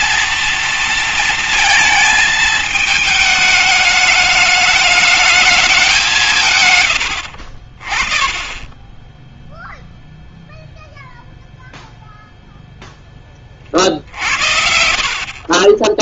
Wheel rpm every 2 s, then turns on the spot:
230, 220, 210, 90, 10, 0, 10, 70.
none